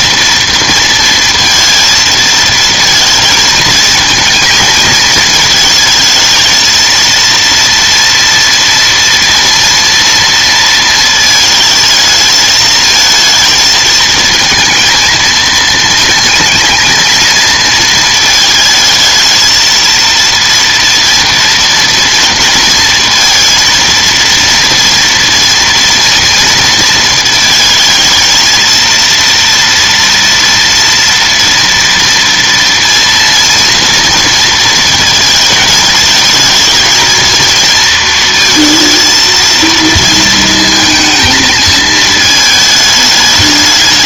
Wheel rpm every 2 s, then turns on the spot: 230, 220, 220, 220, 230, 230, 220, 230, 230, 220, 230, 230, 230, 230, 230, 230, 230, 230, 230, 230, 220, 220.
none